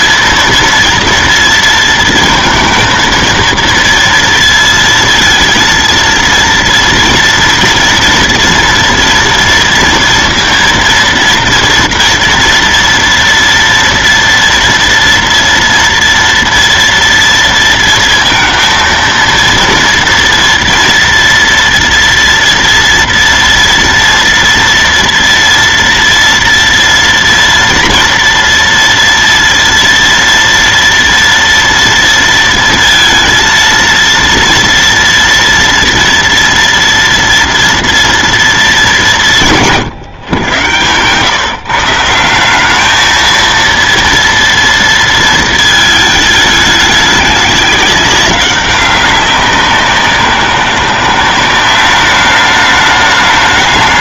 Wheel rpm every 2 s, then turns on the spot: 230, 230, 230, 230, 240, 230, 240, 230, 230, 230, 240, 230, 230, 230, 230, 230, 230, 230, 240, 210, 120, 200, 230, 210, 200, 180, 210.
none